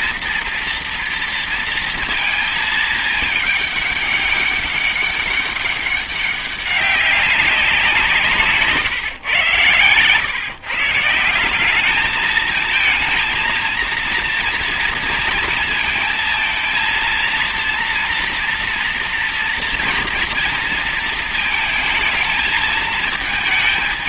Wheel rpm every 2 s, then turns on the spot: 230, 220, 200, 200, 130, 160, 220, 230, 230, 230, 230, 220.
none